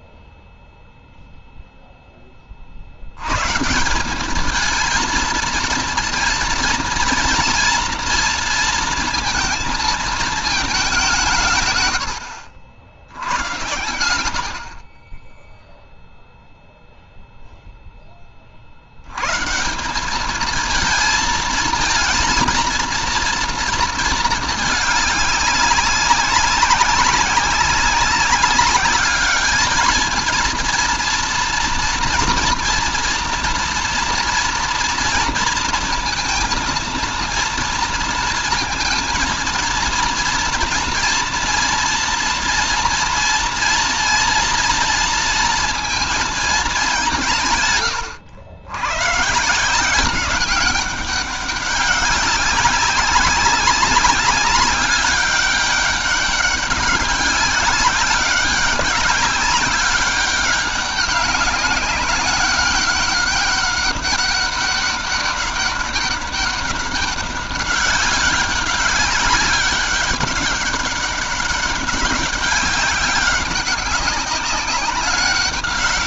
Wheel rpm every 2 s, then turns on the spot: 0, 30, 200, 230, 230, 220, 80, 70, 0, 30, 210, 230, 220, 190, 190, 230, 240, 230, 230, 230, 230, 230, 230, 220, 90, 190, 200, 200, 200, 190, 190, 200, 200, 200, 190, 200, 200, 190.
none